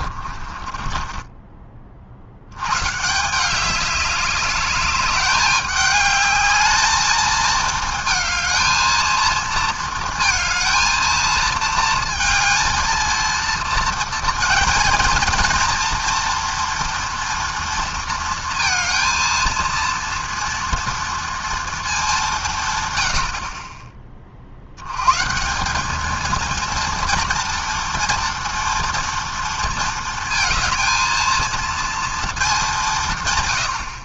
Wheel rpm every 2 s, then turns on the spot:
20, 170, 200, 220, 230, 230, 230, 230, 240, 230, 230, 70, 160, 240, 230, 230, 140.
0-2